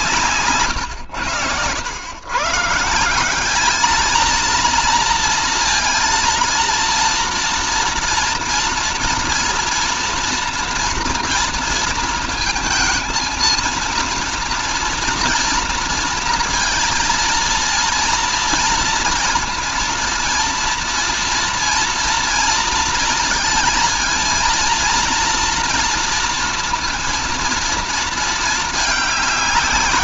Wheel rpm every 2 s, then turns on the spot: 130, 150, 230, 230, 230, 240, 230, 230, 230, 230, 230, 230, 230, 230, 210.
0-2